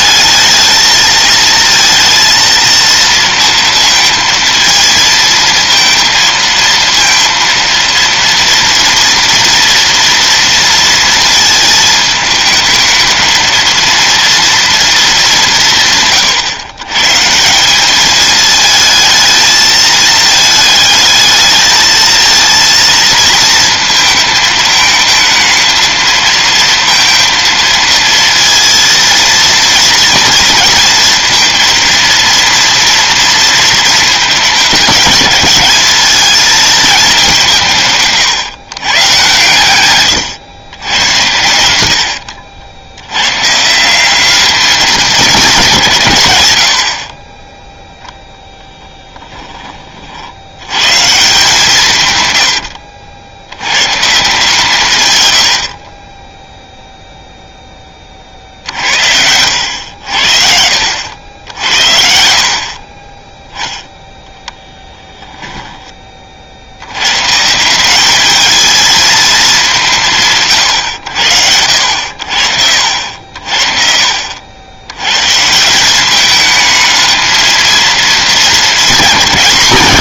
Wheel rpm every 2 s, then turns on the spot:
220, 230, 230, 230, 230, 230, 220, 230, 130, 220, 220, 230, 220, 230, 230, 230, 230, 220, 220, 140, 120, 80, 210, 80, 10, 80, 100, 150, 0, 50, 70, 60, 10, 60, 220, 140, 70, 80, 220, 220.
52-54 64-66